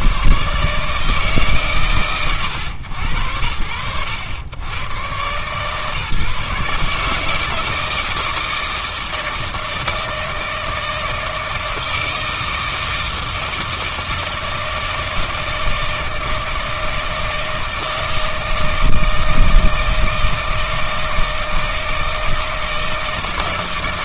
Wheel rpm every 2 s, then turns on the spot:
140, 100, 80, 150, 160, 160, 160, 160, 160, 160, 160, 160.
none